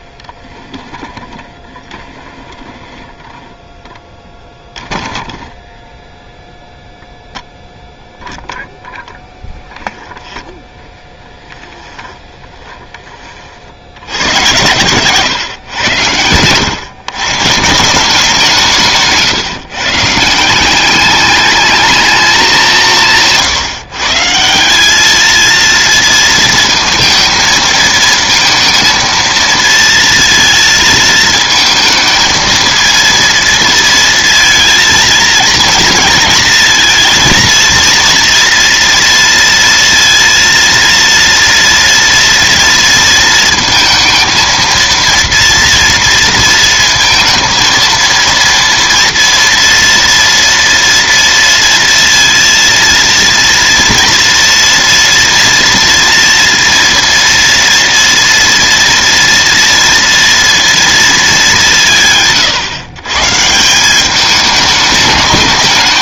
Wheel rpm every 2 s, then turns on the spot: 10, 10, 10, 0, 0, 10, 20, 100, 100, 170, 180, 200, 180, 230, 230, 230, 220, 230, 230, 240, 230, 230, 230, 230, 230, 230, 230, 230, 240, 230, 230, 140, 210.
10-14